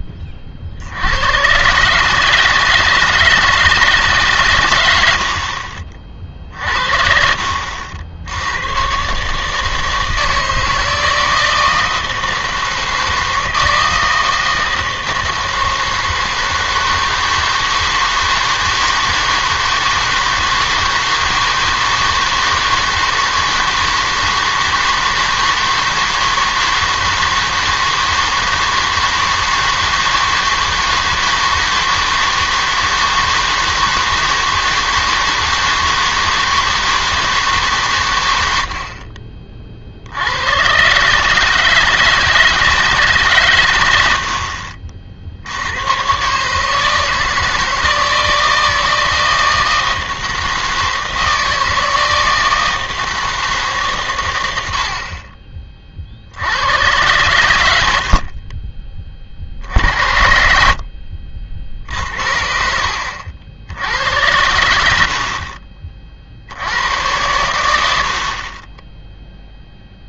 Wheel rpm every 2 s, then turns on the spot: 50, 150, 120, 50, 100, 160, 160, 160, 160, 160, 160, 160, 160, 160, 160, 160, 160, 160, 160, 70, 110, 160, 50, 150, 160, 160, 160, 80, 80, 30, 50, 60, 90, 80, 20.
none